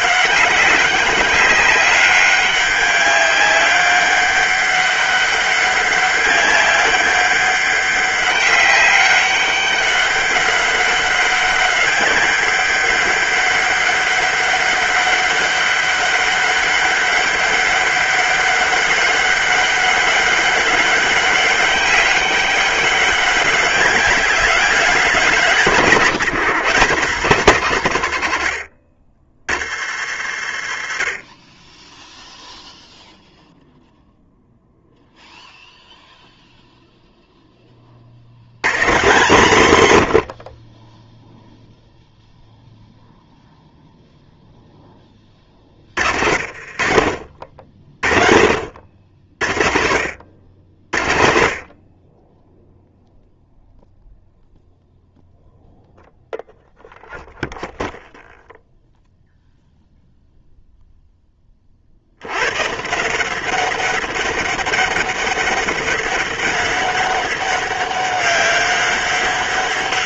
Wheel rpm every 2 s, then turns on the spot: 200, 200, 200, 190, 200, 200, 200, 200, 200, 200, 200, 200, 190, 160, 100, 90, 0, 0, 0, 90, 60, 0, 0, 50, 50, 70, 10, 0, 0, 0, 0, 90, 200, 200, 200.
40-42 46-48